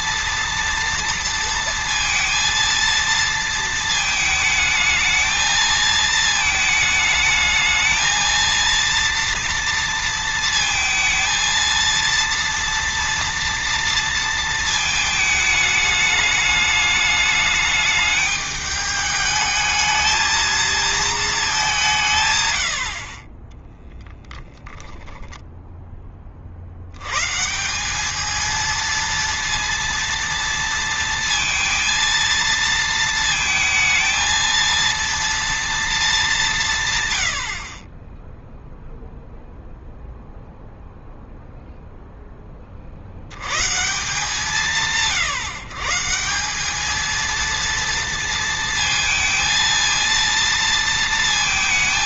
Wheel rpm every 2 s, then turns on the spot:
230, 230, 220, 220, 230, 220, 230, 220, 210, 210, 220, 80, 10, 100, 230, 230, 230, 230, 130, 0, 0, 50, 160, 210, 230, 230.
none